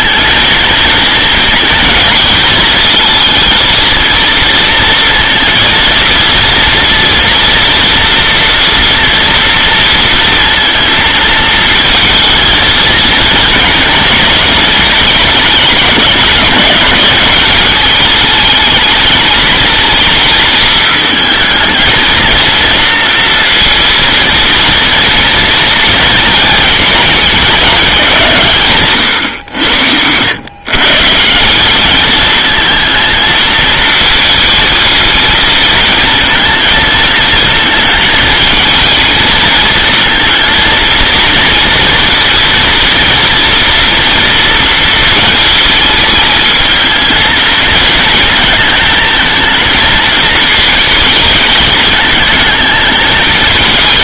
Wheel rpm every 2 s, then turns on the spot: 230, 220, 230, 240, 240, 230, 230, 220, 200, 220, 220, 230, 230, 220, 150, 130, 220, 220, 220, 220, 230, 230, 230, 220, 220, 220, 210.
none